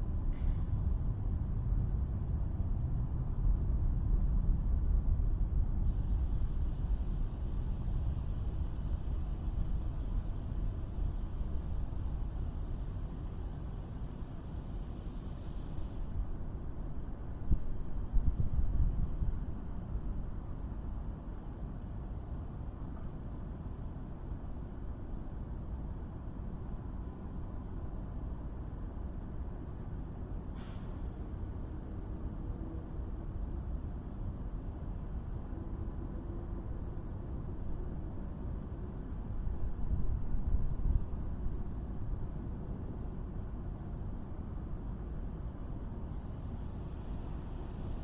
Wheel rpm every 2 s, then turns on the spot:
0, 0, 0, 0, 0, 0, 0, 0, 0, 0, 0, 0, 0, 0, 0, 0, 0, 0, 0, 0, 0, 0, 0, 0.
none